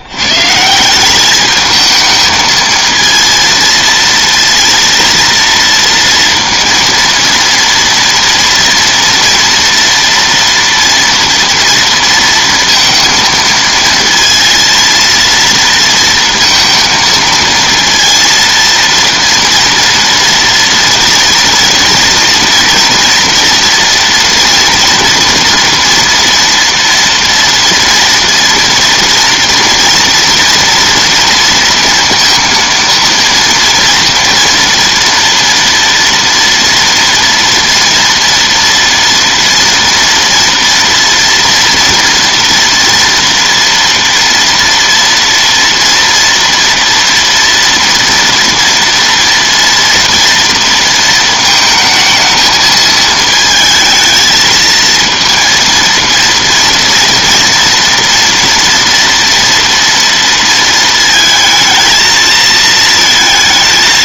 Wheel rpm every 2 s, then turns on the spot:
190, 220, 230, 230, 230, 230, 230, 230, 230, 230, 230, 230, 240, 230, 230, 230, 230, 240, 230, 230, 230, 230, 230, 230, 230, 220, 220, 230, 230, 230, 230, 220.
none